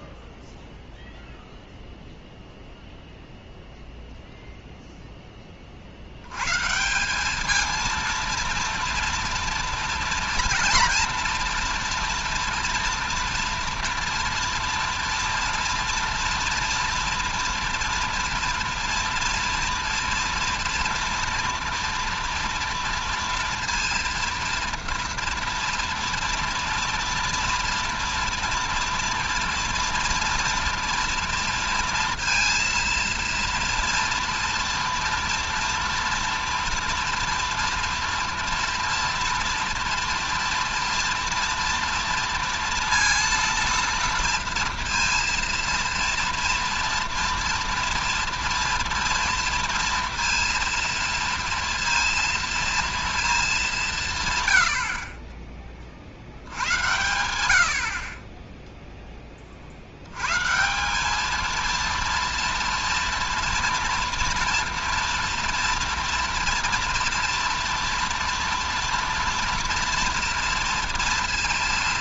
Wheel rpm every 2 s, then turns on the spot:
0, 0, 0, 110, 230, 240, 230, 230, 230, 230, 240, 230, 230, 230, 230, 230, 230, 240, 230, 230, 230, 230, 230, 230, 230, 230, 230, 120, 80, 10, 140, 230, 230, 230, 230, 230.
none